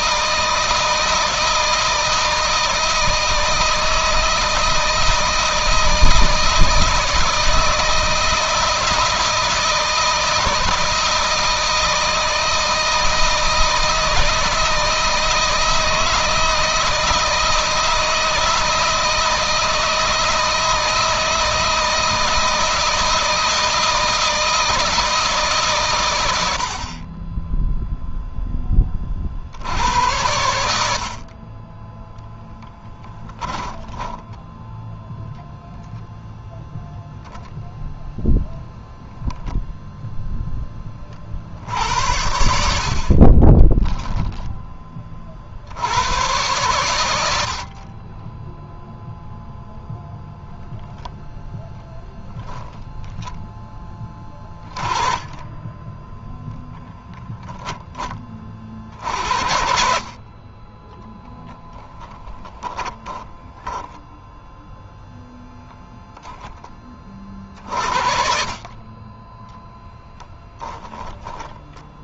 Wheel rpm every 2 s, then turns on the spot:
160, 160, 160, 160, 160, 160, 160, 160, 160, 160, 160, 160, 170, 60, 10, 80, 10, 0, 0, 0, 20, 60, 20, 110, 0, 0, 10, 20, 0, 40, 20, 10, 0, 20, 40, 10.
32-34 42-44 52-54 60-64 70-72